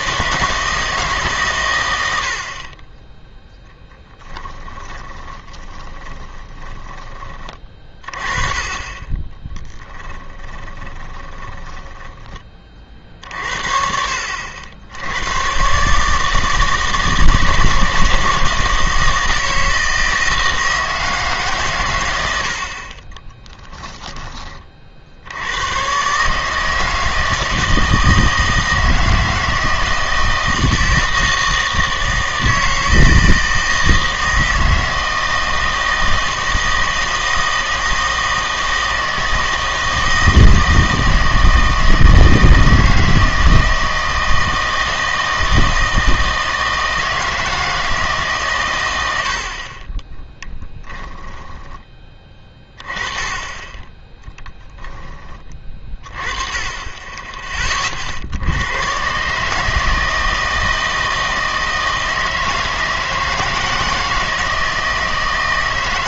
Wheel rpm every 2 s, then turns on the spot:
160, 30, 20, 10, 20, 20, 40, 80, 160, 170, 160, 60, 40, 160, 160, 160, 160, 160, 160, 160, 160, 160, 160, 160, 110, 10, 20, 0, 20, 100, 160, 160, 160.
4-8 10-12 50-52